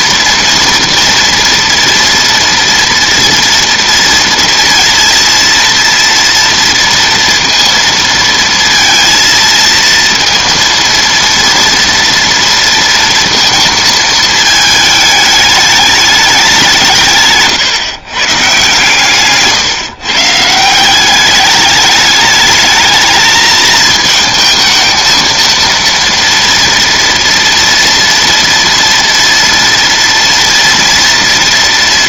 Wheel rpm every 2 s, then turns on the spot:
230, 230, 230, 230, 230, 230, 230, 210, 180, 150, 170, 210, 220, 230, 230, 230.
none